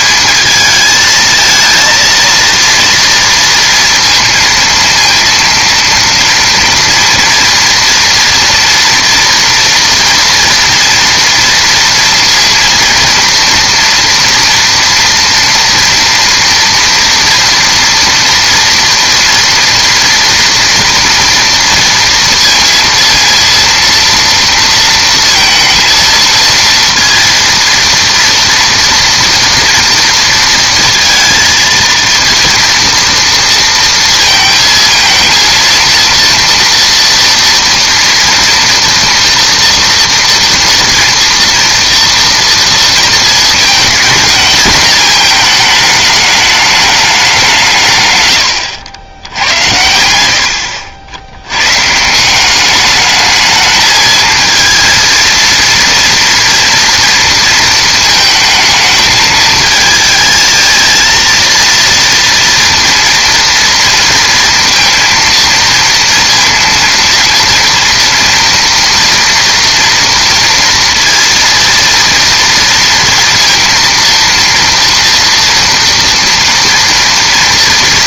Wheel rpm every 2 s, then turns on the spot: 220, 230, 230, 230, 230, 230, 230, 230, 230, 230, 230, 230, 230, 230, 230, 230, 230, 230, 230, 230, 230, 230, 230, 210, 90, 80, 200, 230, 230, 220, 220, 230, 230, 230, 230, 230, 230, 230, 240.
none